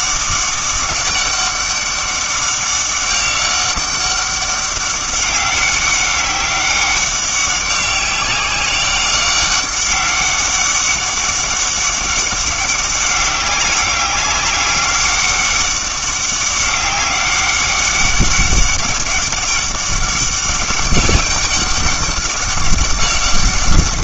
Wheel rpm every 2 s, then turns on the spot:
200, 190, 200, 200, 200, 190, 200, 200, 200, 200, 200, 200.
none